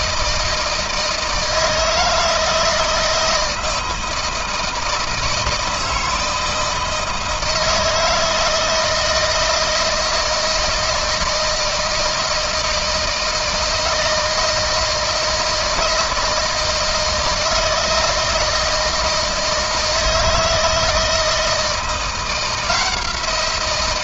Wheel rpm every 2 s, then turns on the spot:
160, 160, 170, 160, 160, 160, 160, 160, 160, 160, 160, 170.
none